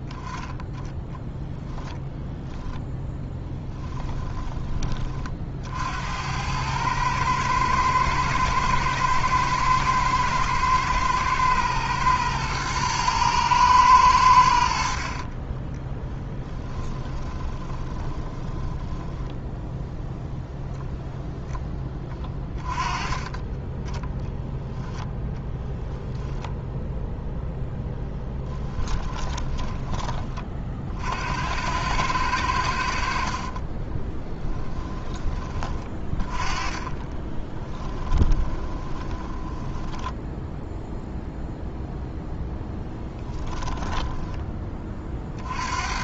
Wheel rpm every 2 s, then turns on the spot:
10, 10, 30, 110, 110, 110, 110, 40, 20, 10, 0, 20, 0, 0, 20, 50, 70, 10, 20, 20, 0, 10, 30.
14-20 22-24 28-30 36-40 42-44